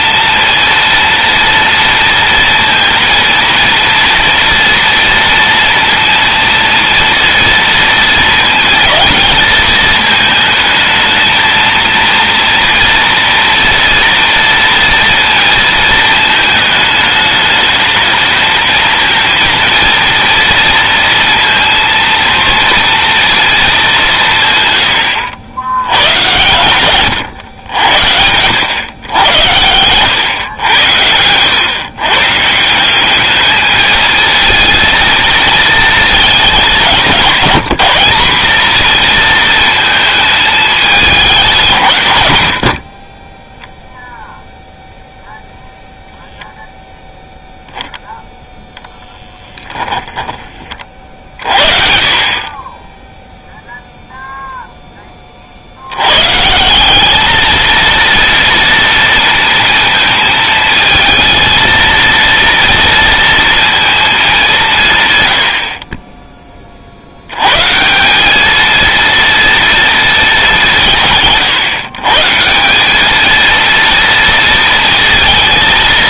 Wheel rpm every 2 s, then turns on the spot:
230, 230, 230, 230, 220, 220, 230, 230, 220, 230, 230, 230, 110, 120, 100, 90, 180, 230, 190, 220, 210, 50, 0, 0, 0, 30, 20, 10, 180, 230, 230, 230, 150, 50, 230, 160, 190, 230.
none